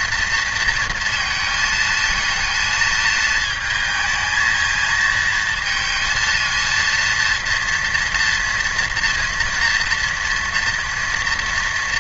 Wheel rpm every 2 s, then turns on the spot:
230, 230, 220, 230, 240, 230.
none